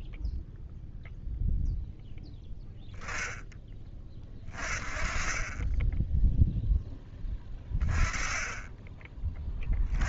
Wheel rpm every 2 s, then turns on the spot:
10, 30, 10, 10, 100.
none